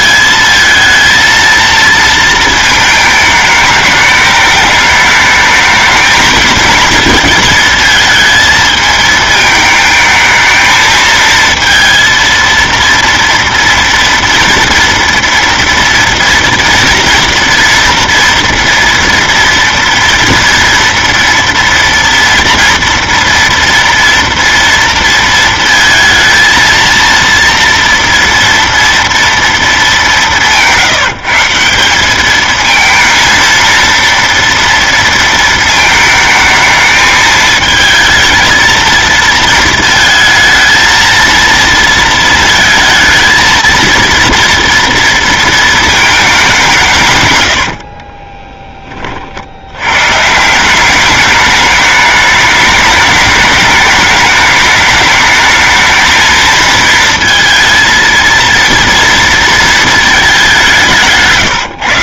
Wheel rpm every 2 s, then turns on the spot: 220, 220, 210, 220, 220, 220, 230, 230, 230, 230, 230, 230, 230, 230, 230, 170, 220, 230, 220, 230, 220, 220, 230, 180, 10, 170, 210, 210, 220, 230, 190.
none